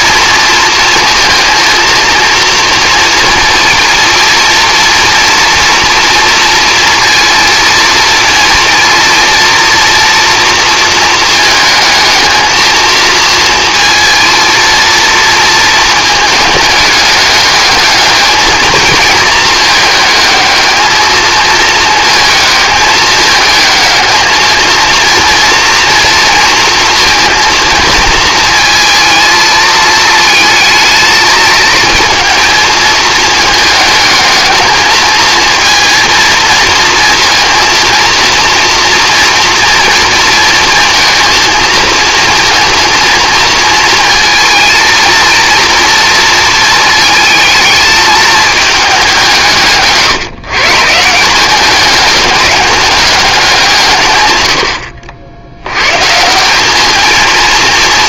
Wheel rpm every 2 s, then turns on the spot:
230, 230, 230, 230, 230, 220, 220, 230, 210, 220, 220, 220, 230, 230, 230, 220, 220, 220, 230, 230, 230, 230, 230, 220, 200, 150, 200, 80, 210.
none